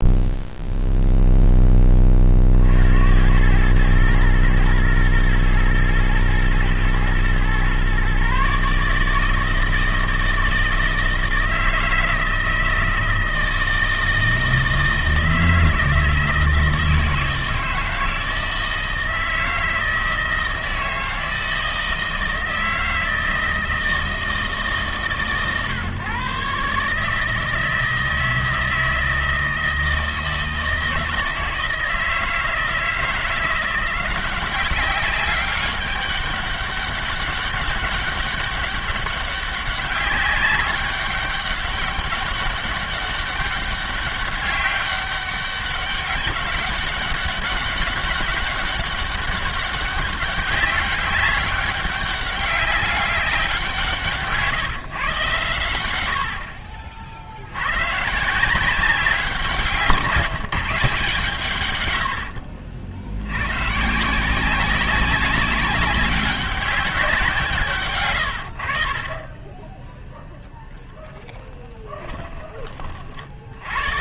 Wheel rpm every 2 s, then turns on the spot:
0, 60, 110, 120, 150, 160, 160, 160, 160, 160, 160, 160, 150, 140, 160, 160, 160, 190, 200, 200, 200, 200, 200, 200, 200, 200, 200, 150, 60, 180, 160, 60, 190, 200, 70, 0, 30.
62-64